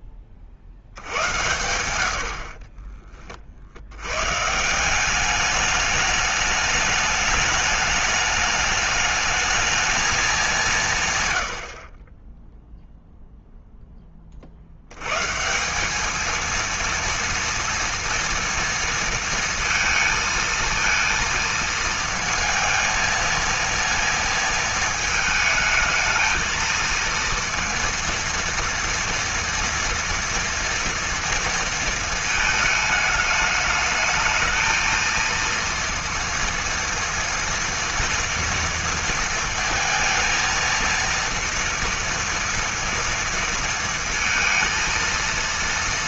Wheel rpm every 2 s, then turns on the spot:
70, 30, 170, 210, 210, 170, 0, 80, 230, 230, 230, 230, 220, 220, 230, 230, 220, 220, 240, 230, 230, 230, 230.
2-4